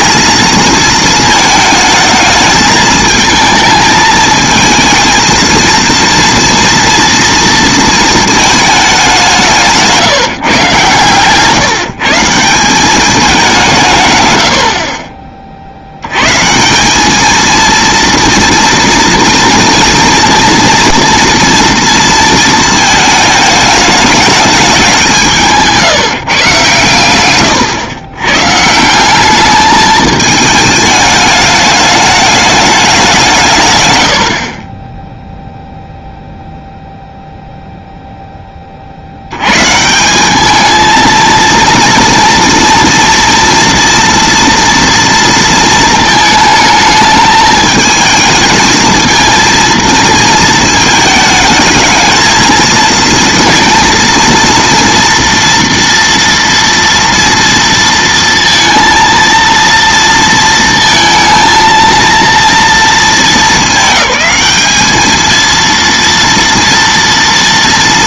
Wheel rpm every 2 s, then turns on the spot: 220, 220, 220, 230, 220, 160, 170, 110, 130, 230, 230, 220, 210, 150, 130, 220, 210, 50, 0, 10, 200, 230, 230, 220, 220, 220, 230, 230, 230, 230, 230, 230, 210, 230.
none